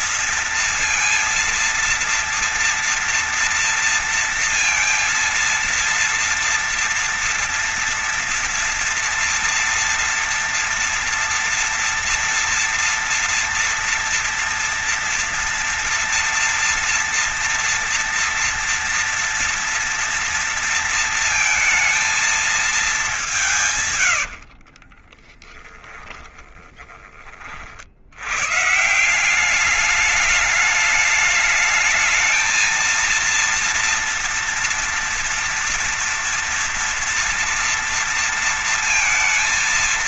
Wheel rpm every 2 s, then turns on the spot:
230, 230, 230, 230, 230, 230, 230, 240, 240, 230, 230, 200, 30, 20, 160, 210, 230, 230, 230, 230.
24-26